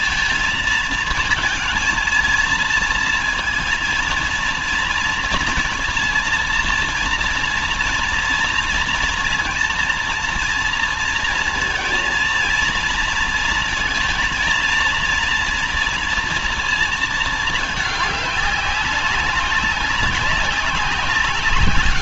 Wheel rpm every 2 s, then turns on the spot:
230, 220, 230, 230, 230, 230, 230, 230, 230, 200, 190.
none